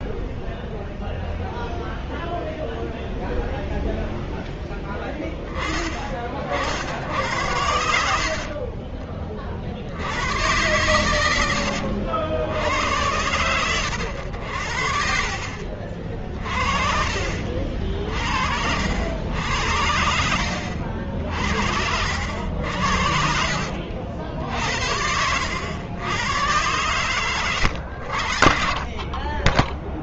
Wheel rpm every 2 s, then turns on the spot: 0, 0, 10, 60, 40, 110, 100, 70, 40, 70, 60, 70, 60, 100, 40.
16-18